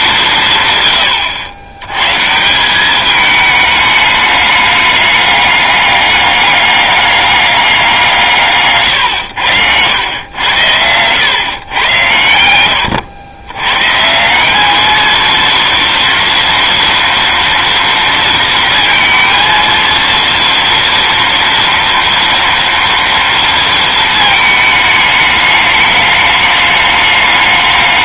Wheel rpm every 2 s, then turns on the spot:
120, 190, 210, 200, 140, 100, 100, 210, 230, 230, 230, 230, 220, 210.
12-14